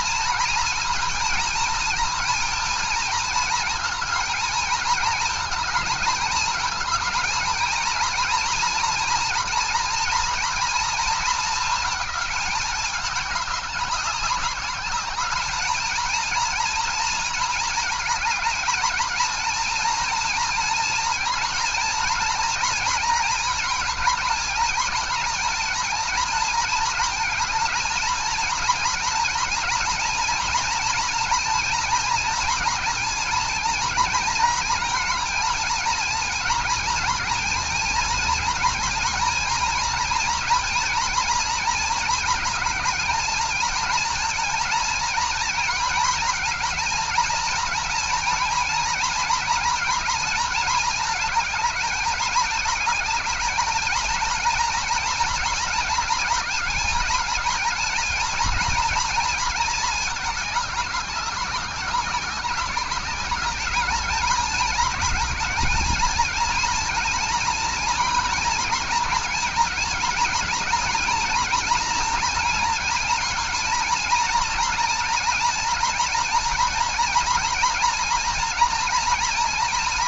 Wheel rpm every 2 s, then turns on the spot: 230, 220, 220, 230, 240, 220, 200, 210, 230, 220, 230, 230, 220, 230, 230, 230, 230, 230, 230, 230, 240, 220, 230, 220, 230, 220, 220, 230, 220, 230, 200, 200, 220, 230, 220, 220, 230, 230, 230, 230.
none